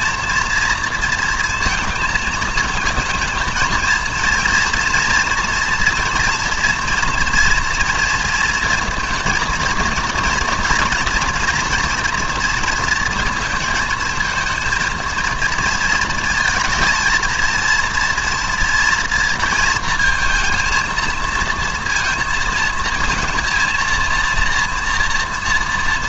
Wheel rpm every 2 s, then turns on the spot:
230, 220, 230, 230, 230, 230, 230, 230, 230, 230, 220, 220, 230.
none